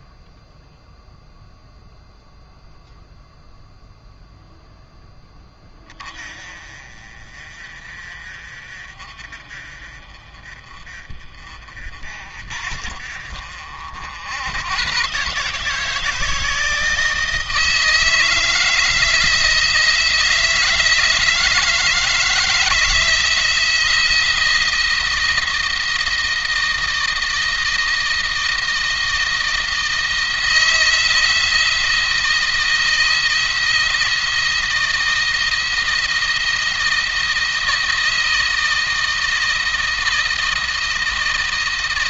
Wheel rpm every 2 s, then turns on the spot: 0, 0, 0, 30, 50, 40, 50, 120, 160, 160, 160, 160, 170, 170, 170, 170, 160, 170, 160, 160, 170.
none